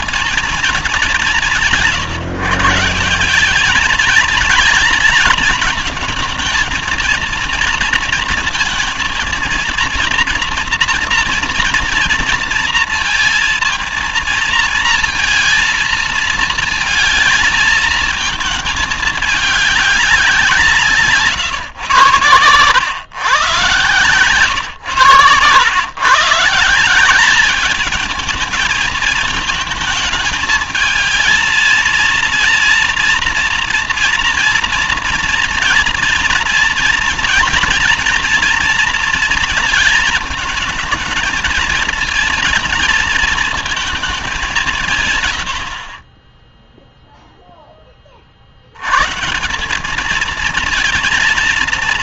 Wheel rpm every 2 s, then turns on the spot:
220, 160, 220, 220, 230, 230, 230, 220, 230, 220, 170, 120, 120, 170, 220, 220, 230, 240, 230, 240, 220, 220, 190, 10, 70, 220.
none